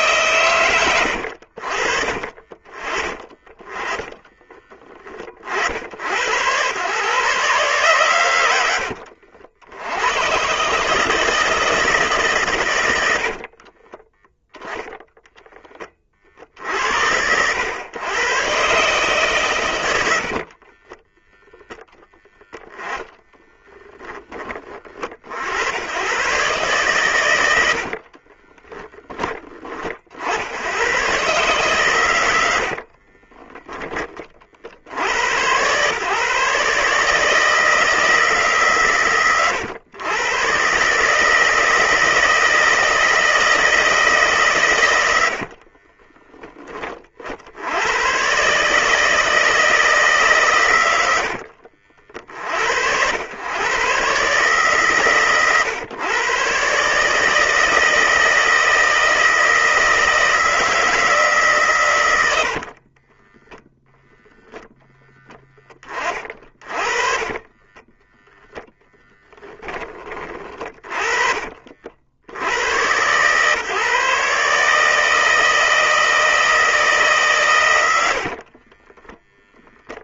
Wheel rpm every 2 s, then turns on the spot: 110, 40, 20, 120, 90, 150, 90, 0, 80, 140, 30, 10, 40, 120, 10, 100, 50, 70, 150, 130, 140, 160, 100, 30, 150, 90, 80, 140, 140, 160, 160, 40, 0, 30, 10, 40, 100, 150, 160, 20.
20-24 32-34 50-52 62-64 66-70 78-80